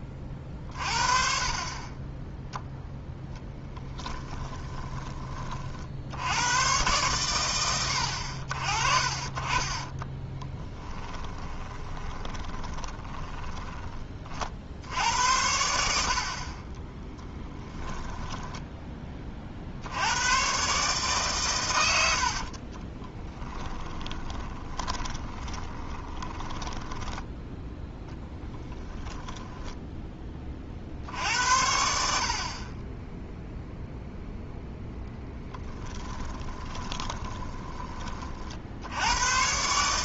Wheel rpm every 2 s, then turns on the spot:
20, 0, 20, 80, 60, 10, 10, 60, 40, 10, 140, 50, 30, 10, 10, 40, 30, 10, 20, 60.
4-6 10-14 22-28 36-38